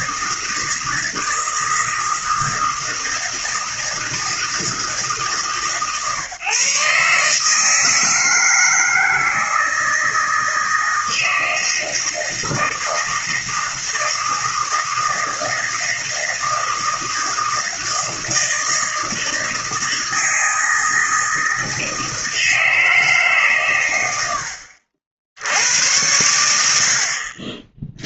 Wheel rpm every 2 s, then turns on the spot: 160, 160, 160, 140, 160, 160, 160, 160, 160, 160, 160, 160, 70, 90.
none